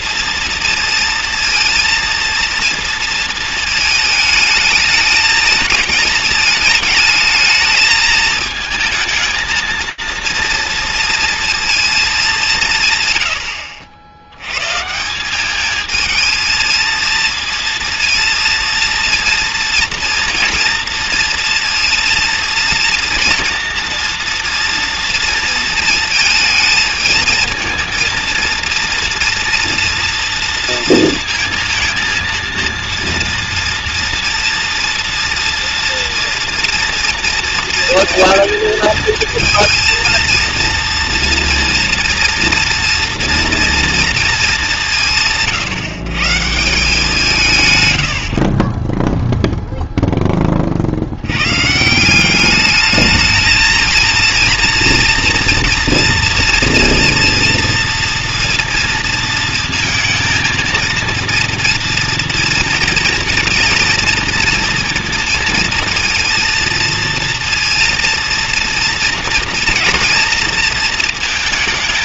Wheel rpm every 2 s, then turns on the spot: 230, 230, 220, 220, 220, 230, 170, 110, 220, 230, 230, 230, 230, 220, 230, 230, 230, 230, 240, 230, 230, 230, 210, 150, 40, 30, 200, 230, 230, 230, 220, 230, 240, 230, 230, 230.
none